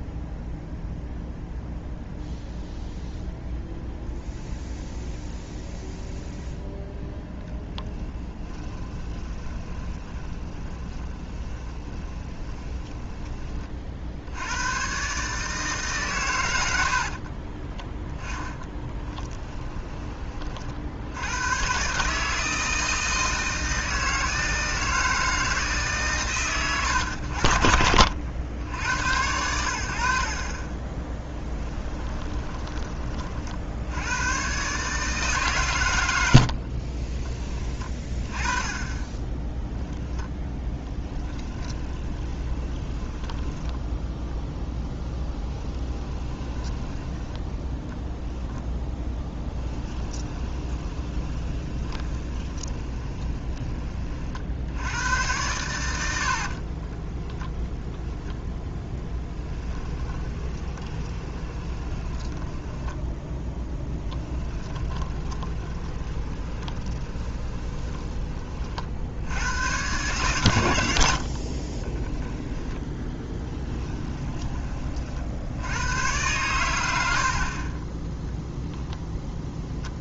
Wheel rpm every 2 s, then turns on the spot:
0, 0, 0, 0, 20, 20, 20, 120, 80, 10, 60, 160, 160, 110, 90, 20, 30, 150, 50, 20, 10, 20, 10, 10, 10, 20, 20, 90, 40, 10, 20, 10, 20, 20, 50, 90, 10, 40, 90, 0.
8-14 18-20 30-32 36-38 40-44 48-54 56-58 60-68 72-74